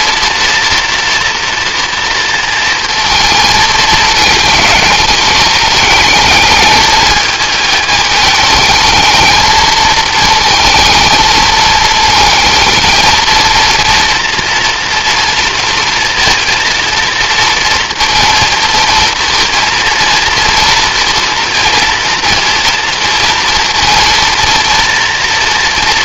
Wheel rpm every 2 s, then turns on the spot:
230, 220, 210, 210, 230, 220, 220, 230, 230, 230, 230, 230, 230.
none